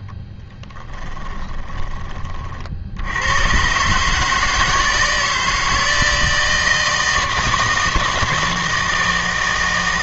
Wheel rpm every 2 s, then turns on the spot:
20, 60, 160, 160, 160.
0-2